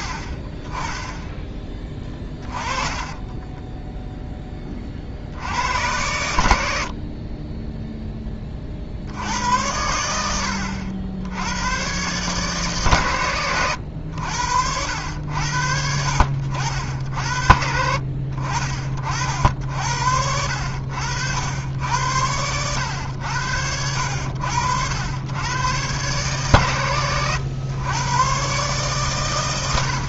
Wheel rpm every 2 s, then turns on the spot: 10, 30, 40, 60, 60, 80, 140, 80, 60, 50, 80, 90, 90, 120, 130.
2-4